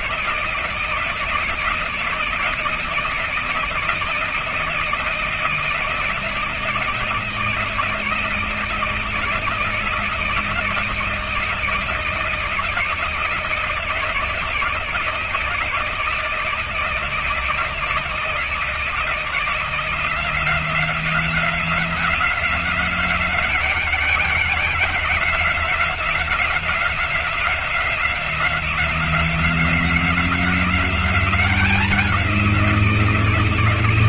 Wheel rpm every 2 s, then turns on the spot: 160, 160, 160, 170, 160, 160, 160, 160, 160, 160, 170, 180, 180, 180, 180, 180, 180.
none